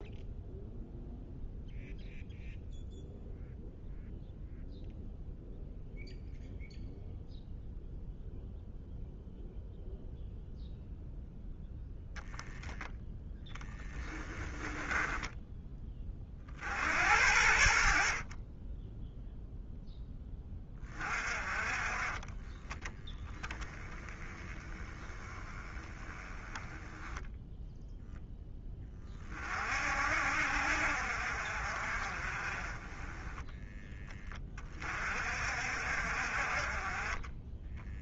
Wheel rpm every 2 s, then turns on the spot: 0, 0, 0, 0, 0, 0, 0, 10, 70, 0, 30, 20, 20, 10, 30, 60, 20, 40, 30.
14-16